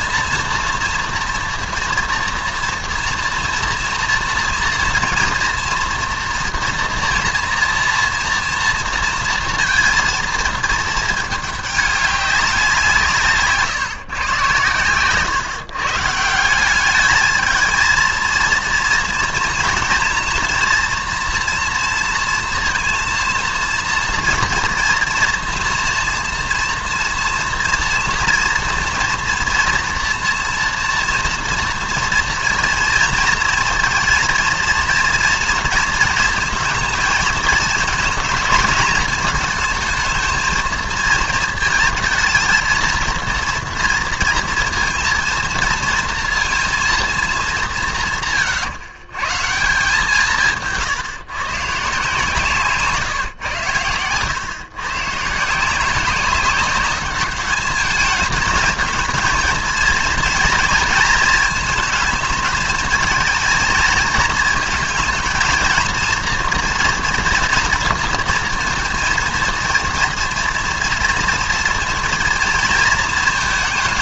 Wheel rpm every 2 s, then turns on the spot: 230, 230, 230, 230, 230, 220, 180, 120, 190, 230, 230, 230, 240, 230, 230, 240, 240, 230, 220, 220, 220, 230, 230, 230, 130, 160, 140, 130, 200, 220, 230, 220, 230, 230, 230, 230, 230.
none